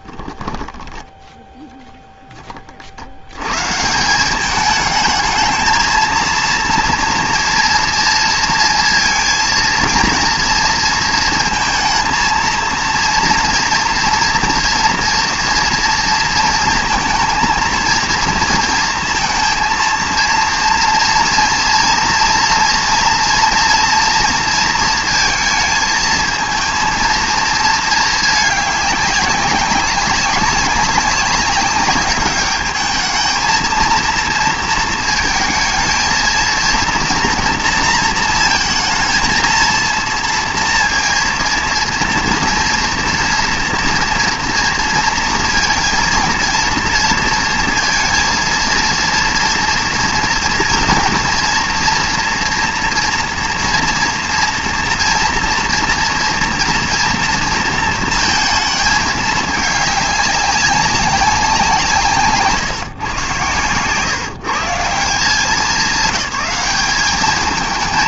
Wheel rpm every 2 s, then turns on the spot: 10, 30, 200, 230, 230, 230, 230, 230, 230, 230, 230, 230, 230, 230, 210, 190, 210, 230, 230, 220, 230, 230, 230, 230, 230, 240, 240, 230, 230, 220, 200, 140, 140, 200.
0-2